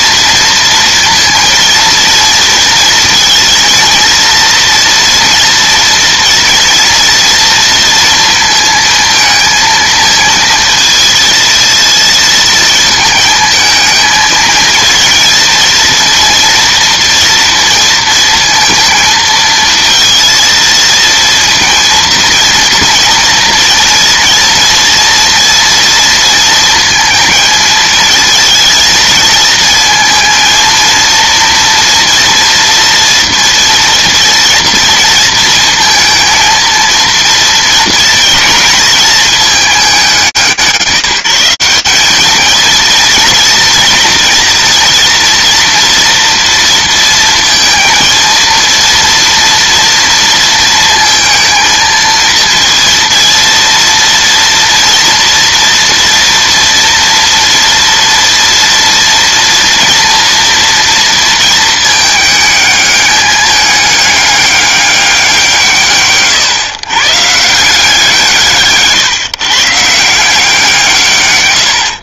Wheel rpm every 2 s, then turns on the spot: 230, 230, 230, 230, 230, 230, 220, 220, 230, 220, 230, 230, 230, 230, 220, 230, 230, 230, 230, 220, 170, 230, 230, 230, 230, 230, 230, 230, 230, 230, 230, 210, 200, 120, 150, 160.
none